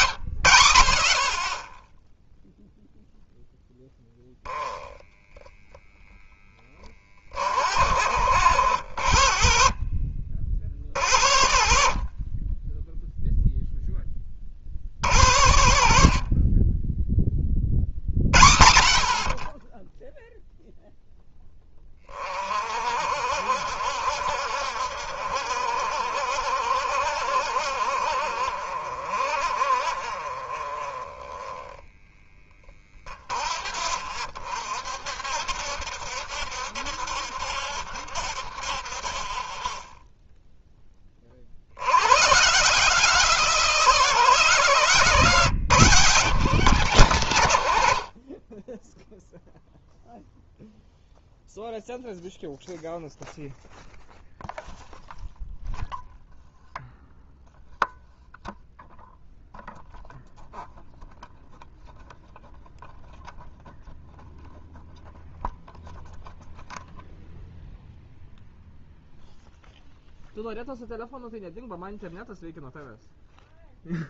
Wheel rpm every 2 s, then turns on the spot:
70, 0, 10, 30, 80, 50, 10, 50, 20, 60, 0, 50, 60, 70, 50, 30, 20, 60, 70, 40, 20, 160, 160, 160, 10, 0, 0, 0, 0, 0, 0, 0, 0, 0, 0, 0, 0.
none